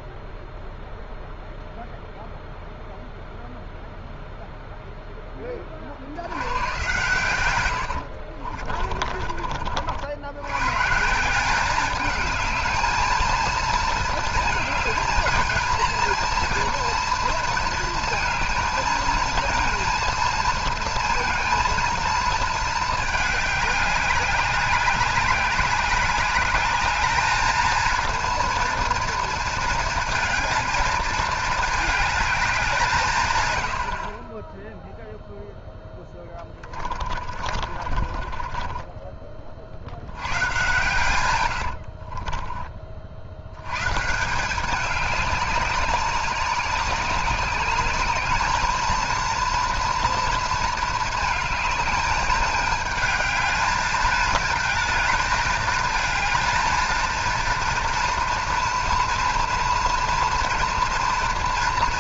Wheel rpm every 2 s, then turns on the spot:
0, 0, 0, 110, 40, 110, 220, 230, 230, 220, 230, 220, 190, 210, 230, 230, 190, 10, 30, 30, 100, 30, 190, 190, 220, 230, 210, 220, 230, 240, 230.
8-10 36-40